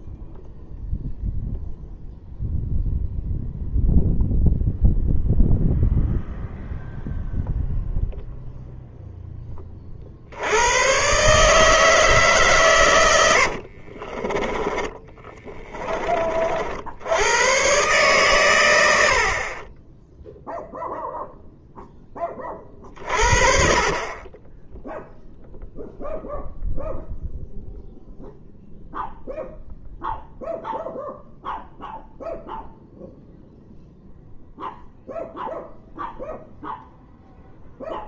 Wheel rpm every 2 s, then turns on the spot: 0, 0, 0, 0, 0, 120, 110, 20, 70, 140, 0, 40, 0, 0, 0, 0, 0, 0, 0.
14-16